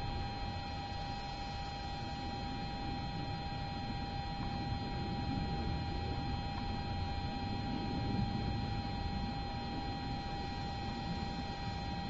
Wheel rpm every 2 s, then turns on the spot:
0, 0, 0, 0, 0, 0.
none